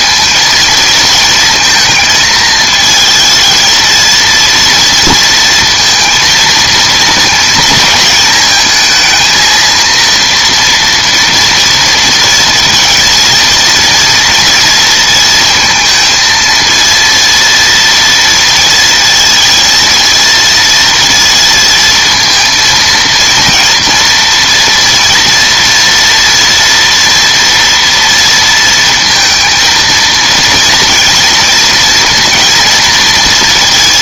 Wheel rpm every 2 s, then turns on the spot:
230, 220, 230, 230, 220, 230, 230, 230, 230, 230, 230, 230, 230, 240, 230, 230, 230.
none